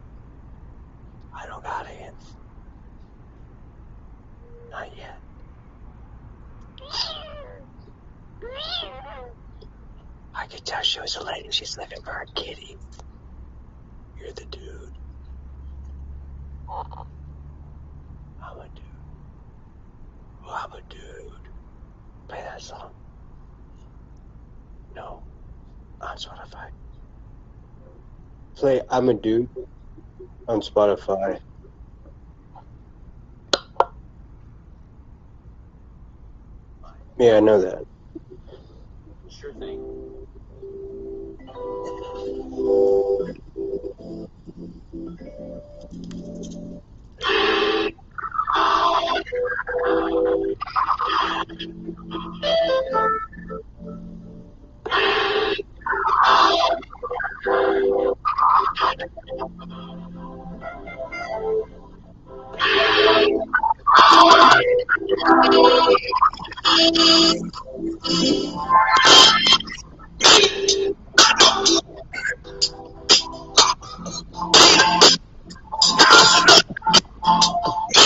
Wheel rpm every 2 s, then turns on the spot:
0, 0, 0, 0, 0, 0, 0, 0, 0, 0, 0, 0, 0, 0, 0, 0, 0, 0, 0, 0, 0, 0, 0, 0, 0, 0, 0, 0, 0, 0, 0, 0, 0, 0, 0, 0, 0, 0, 0.
none